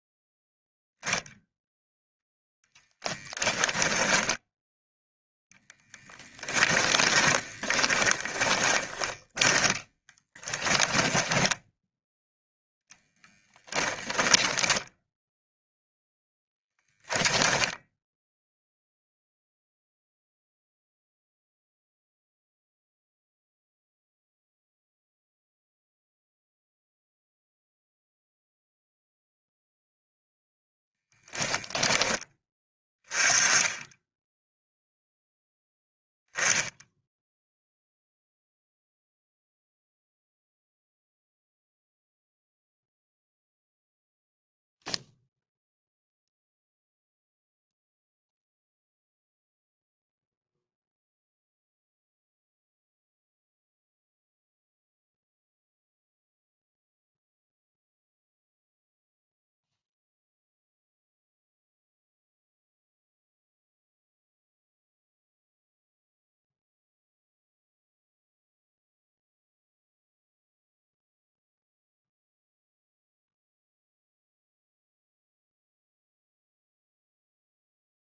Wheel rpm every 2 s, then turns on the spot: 0, 0, 10, 20, 20, 20, 0, 10, 10, 0, 0, 0, 0, 0, 0, 10, 20, 0, 0, 0, 0, 0, 0, 0, 0, 0, 0, 0, 0, 0, 0, 0, 0, 0, 0, 0, 0, 0, 0.
6-12 14-18 30-32